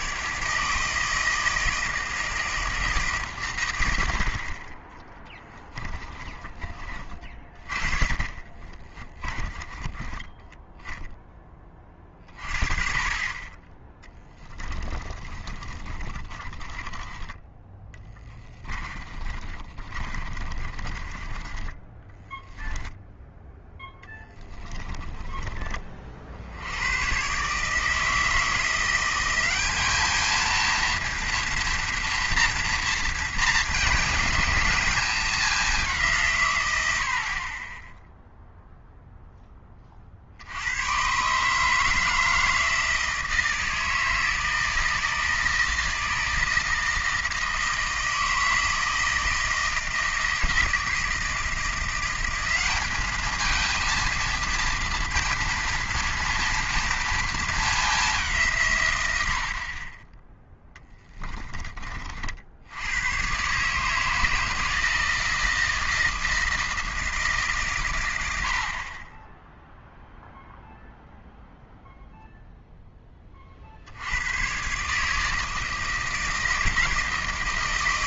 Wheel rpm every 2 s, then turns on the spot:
150, 160, 30, 30, 30, 10, 30, 20, 20, 20, 30, 10, 30, 80, 170, 220, 230, 220, 120, 0, 90, 160, 160, 160, 160, 160, 200, 230, 230, 140, 10, 80, 160, 160, 80, 0, 0, 120, 160.
8-10 14-22 24-26 60-62